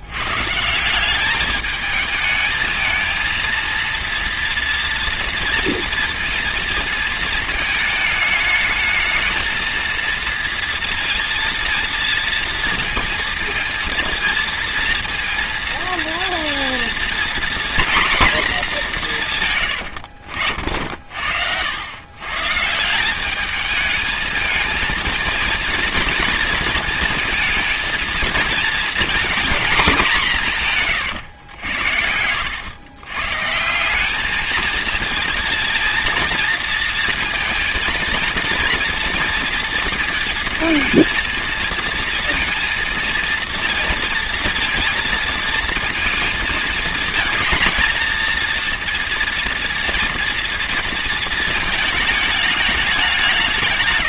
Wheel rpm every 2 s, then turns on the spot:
160, 220, 230, 230, 210, 230, 230, 230, 230, 220, 60, 150, 220, 230, 220, 150, 100, 220, 230, 230, 230, 230, 230, 220, 230, 230, 210.
none